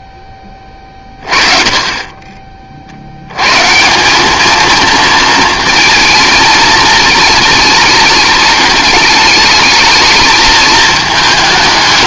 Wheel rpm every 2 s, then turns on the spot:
20, 40, 220, 220, 210, 220.
none